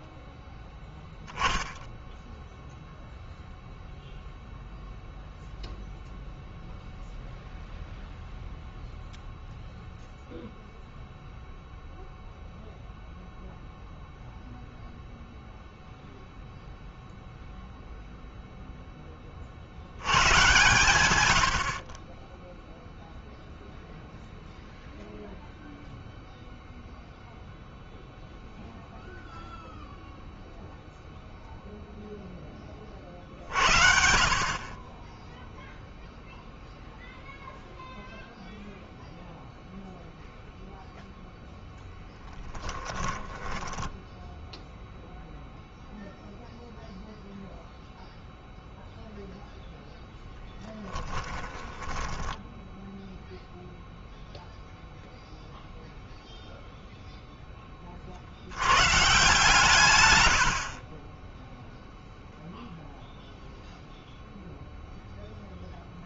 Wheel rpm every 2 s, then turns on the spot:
0, 0, 0, 0, 0, 0, 0, 0, 0, 0, 110, 10, 0, 0, 0, 0, 20, 40, 0, 0, 0, 10, 10, 0, 0, 0, 10, 0, 0, 80, 70, 0, 0.
42-46 52-54